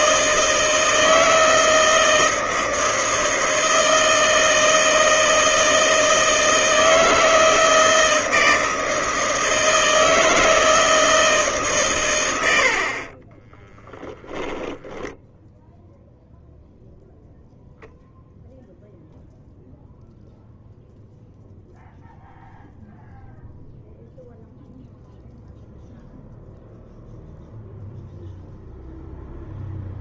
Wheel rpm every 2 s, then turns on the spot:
160, 160, 160, 160, 160, 160, 60, 10, 0, 0, 0, 0, 0, 0, 0.
none